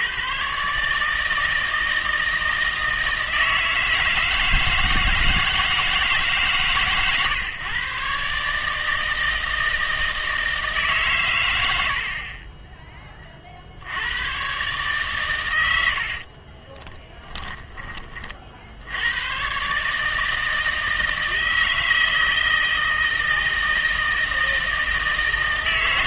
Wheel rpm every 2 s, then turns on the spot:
150, 160, 160, 140, 160, 150, 20, 130, 20, 70, 160, 160, 160.
16-18